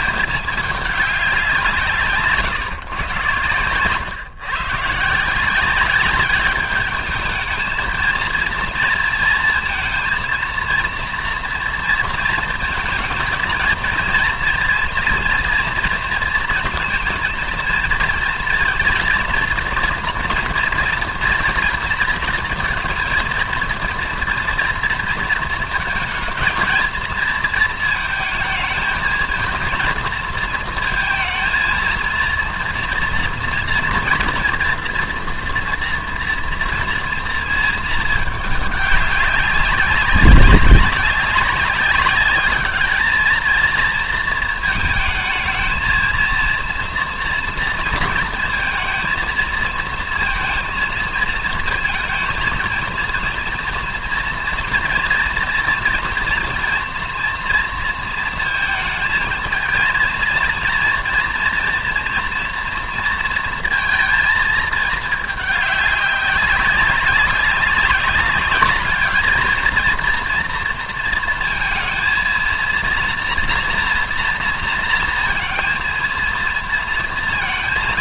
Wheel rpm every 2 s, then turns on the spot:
210, 140, 130, 200, 230, 230, 230, 240, 230, 230, 240, 230, 240, 220, 220, 230, 230, 230, 230, 210, 200, 210, 220, 230, 230, 230, 220, 230, 230, 230, 230, 240, 230, 190, 210, 230, 230, 230, 230.
none